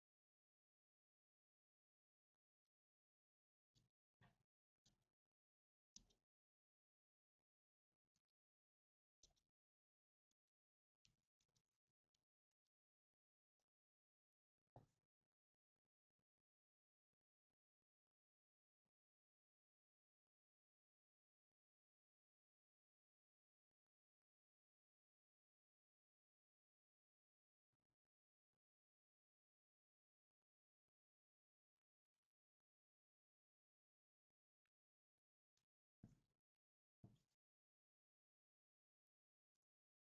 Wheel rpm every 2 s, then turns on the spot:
0, 0, 0, 0, 0, 0, 0, 0, 0, 0, 0, 0, 0, 0, 0, 0, 0, 0, 0, 0.
none